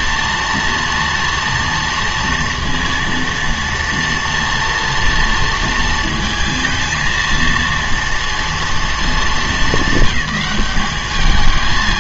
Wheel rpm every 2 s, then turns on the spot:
230, 230, 230, 220, 230, 200.
none